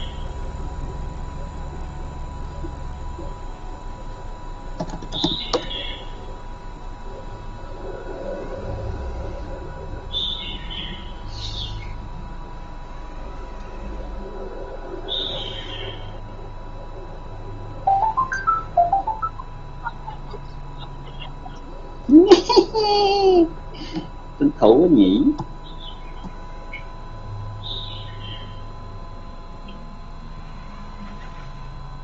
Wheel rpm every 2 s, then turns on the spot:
10, 0, 0, 0, 0, 0, 0, 0, 0, 0, 0, 0, 0, 0, 0, 0.
none